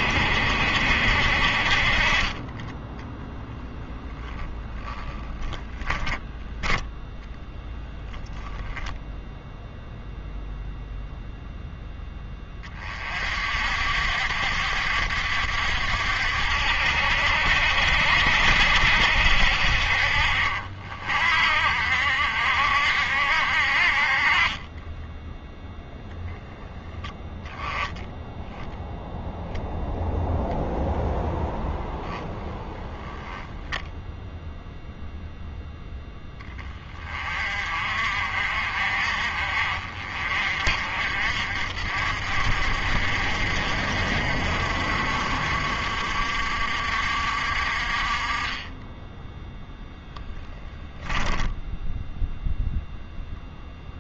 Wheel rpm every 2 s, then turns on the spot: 60, 20, 10, 10, 10, 0, 20, 60, 60, 60, 50, 60, 20, 0, 0, 0, 0, 0, 20, 50, 50, 50, 50, 60, 20, 10, 0.
4-8 24-26 50-52